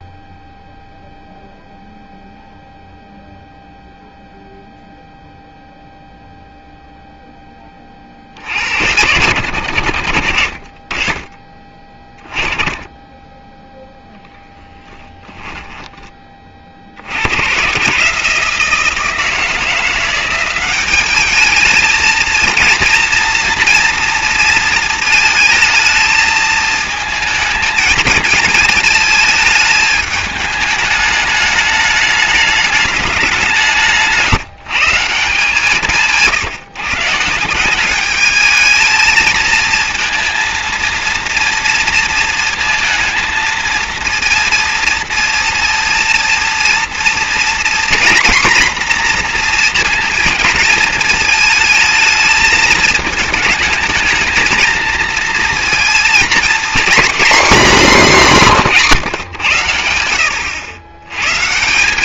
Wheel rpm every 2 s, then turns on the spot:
0, 0, 0, 0, 110, 20, 20, 10, 70, 160, 200, 230, 230, 220, 220, 210, 190, 170, 160, 220, 230, 230, 230, 230, 230, 220, 220, 230, 250, 140, 120.
none